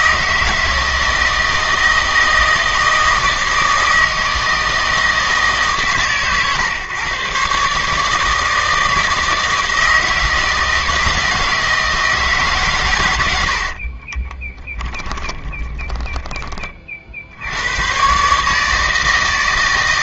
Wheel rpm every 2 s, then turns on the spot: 160, 160, 160, 130, 160, 160, 130, 20, 30, 160.
14-16